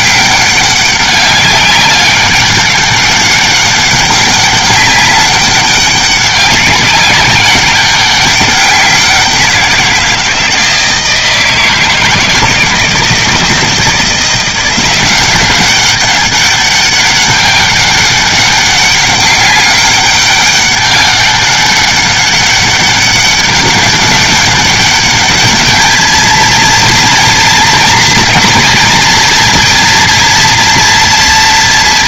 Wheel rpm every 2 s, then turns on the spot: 200, 190, 200, 190, 190, 160, 160, 180, 200, 200, 200, 200, 200, 230, 230, 230.
none